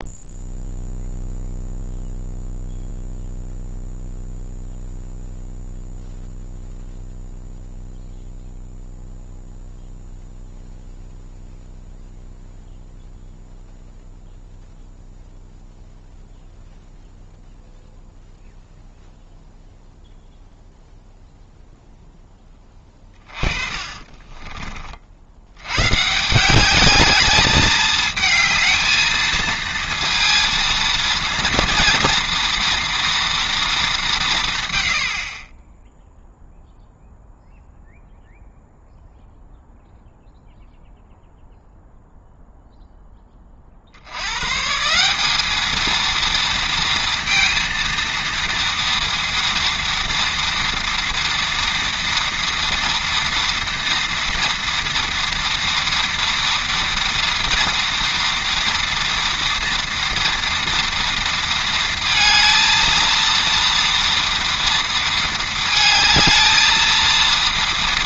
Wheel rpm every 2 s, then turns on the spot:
0, 0, 0, 0, 0, 0, 0, 0, 0, 0, 0, 20, 50, 200, 220, 230, 230, 110, 0, 0, 0, 10, 170, 230, 230, 230, 230, 240, 230, 230, 230, 230, 230, 230.
22-24